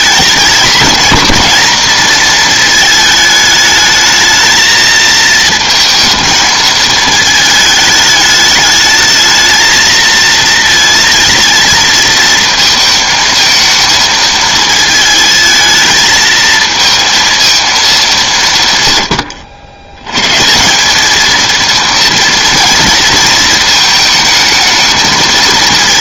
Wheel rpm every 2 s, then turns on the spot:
220, 220, 220, 220, 210, 220, 230, 220, 220, 150, 170, 230, 220.
none